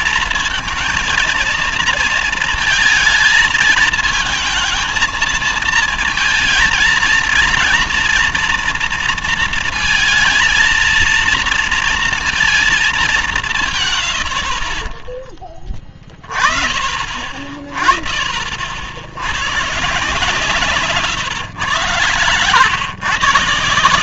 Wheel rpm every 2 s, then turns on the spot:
230, 220, 220, 220, 230, 230, 230, 40, 40, 50, 160, 110.
20-22